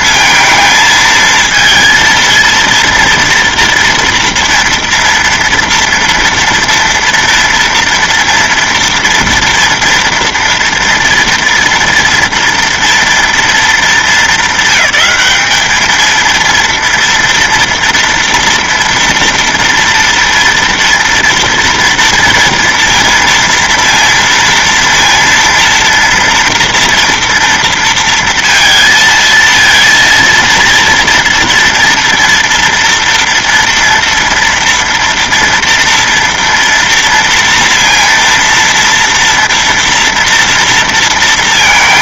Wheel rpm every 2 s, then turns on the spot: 220, 230, 230, 230, 240, 230, 230, 220, 230, 230, 230, 230, 230, 230, 230, 230, 230, 230, 230, 230, 230.
none